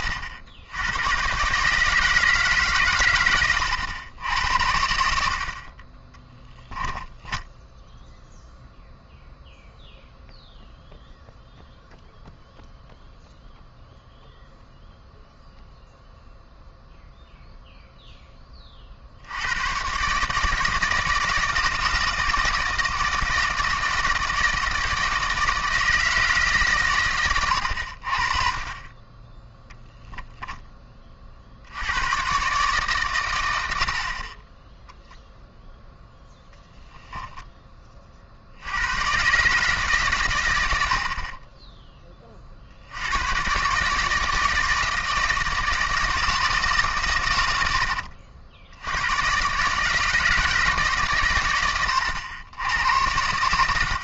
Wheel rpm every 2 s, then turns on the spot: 80, 130, 70, 10, 0, 0, 0, 0, 0, 30, 160, 160, 160, 140, 30, 20, 140, 10, 10, 90, 90, 50, 160, 140, 70, 160, 90.
6-8 36-38